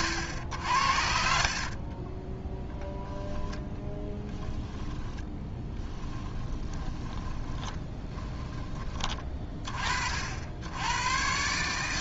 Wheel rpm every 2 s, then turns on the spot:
90, 0, 10, 20, 20, 100.
4-10